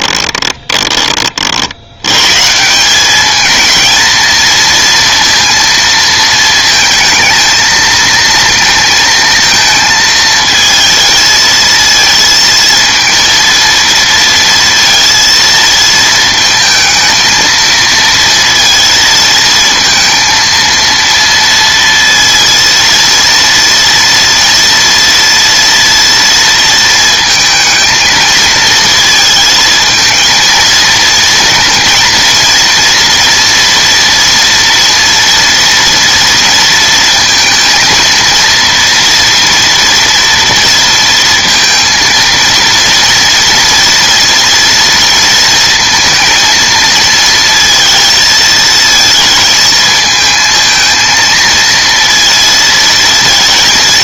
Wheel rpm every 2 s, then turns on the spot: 20, 160, 230, 220, 230, 220, 220, 230, 220, 230, 230, 230, 230, 230, 220, 230, 230, 230, 230, 230, 230, 230, 230, 230, 220, 220, 230.
0-2